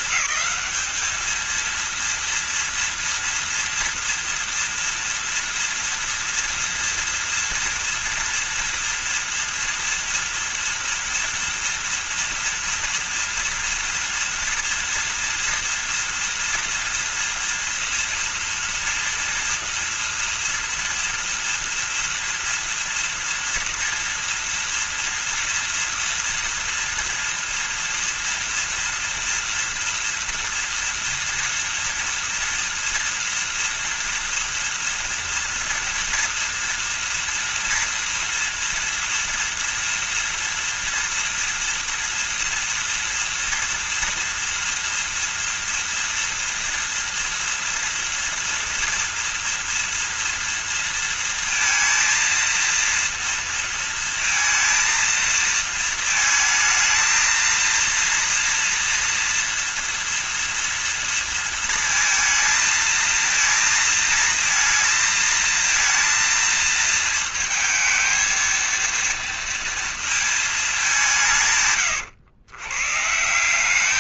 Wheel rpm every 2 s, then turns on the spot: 220, 230, 230, 230, 230, 230, 240, 230, 230, 230, 230, 230, 230, 230, 230, 230, 230, 240, 230, 230, 230, 230, 230, 240, 230, 230, 230, 230, 220, 230, 230, 230, 230, 230, 230, 220, 110.
none